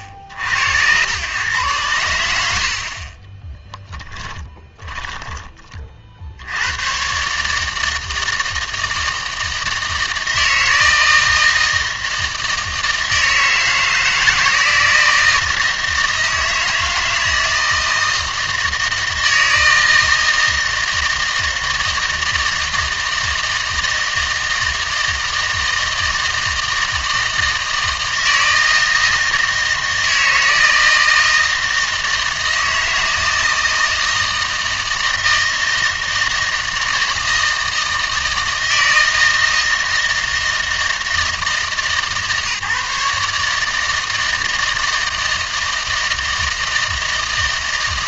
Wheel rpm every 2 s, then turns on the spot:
80, 70, 10, 80, 160, 160, 160, 160, 160, 160, 160, 160, 160, 160, 160, 160, 160, 160, 160, 160, 160, 150, 160, 160.
4-6